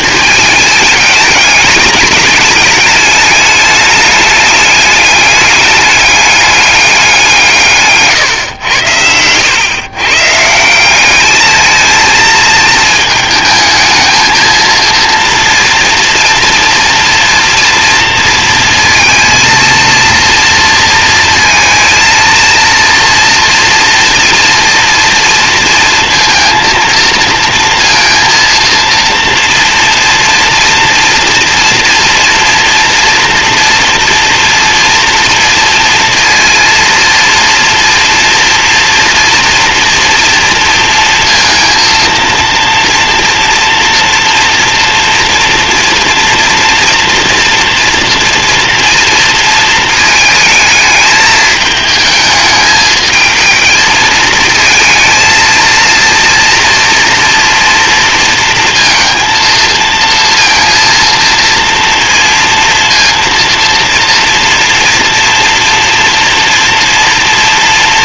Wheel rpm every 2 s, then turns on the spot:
210, 210, 210, 210, 110, 170, 220, 220, 230, 230, 230, 230, 240, 230, 230, 230, 230, 230, 230, 230, 230, 230, 230, 240, 230, 210, 220, 220, 230, 230, 230, 230, 230, 230.
none